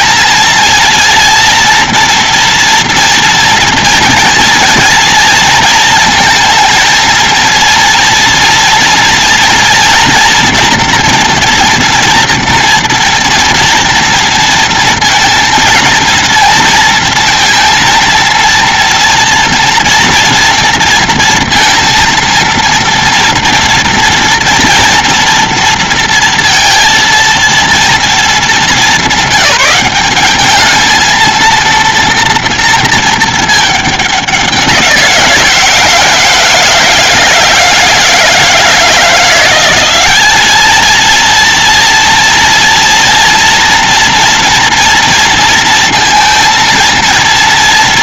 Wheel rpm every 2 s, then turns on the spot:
230, 240, 230, 230, 230, 230, 230, 230, 230, 230, 240, 230, 230, 230, 220, 200, 230, 200, 160, 160, 200, 230, 230, 230.
none